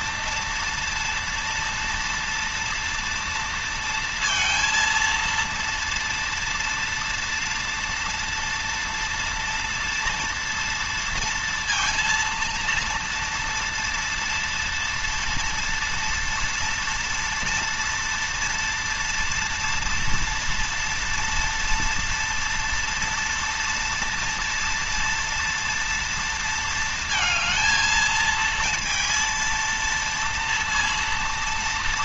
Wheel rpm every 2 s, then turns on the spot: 230, 230, 230, 230, 230, 230, 230, 230, 230, 230, 230, 230, 230, 230, 230, 230.
none